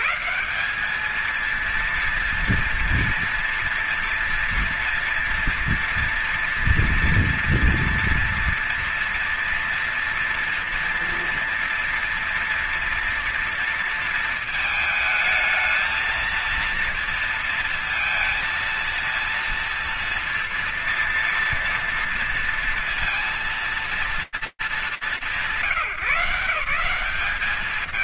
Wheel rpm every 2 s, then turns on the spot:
150, 230, 230, 230, 230, 230, 240, 230, 220, 230, 230, 230, 220, 180.
none